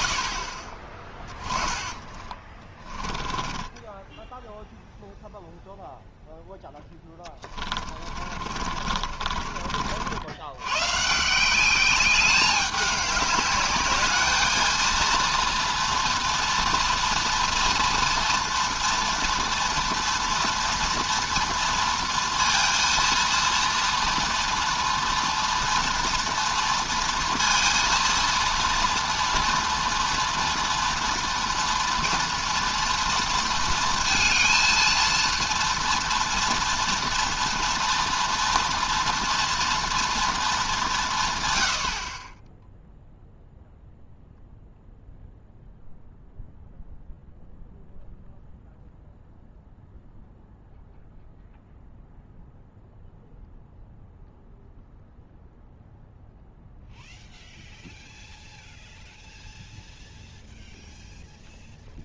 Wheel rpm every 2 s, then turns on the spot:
40, 20, 0, 10, 40, 120, 200, 220, 230, 230, 230, 230, 230, 230, 230, 240, 230, 220, 230, 230, 200, 0, 0, 0, 0, 0, 0, 0, 0, 0, 0.
2-4 6-10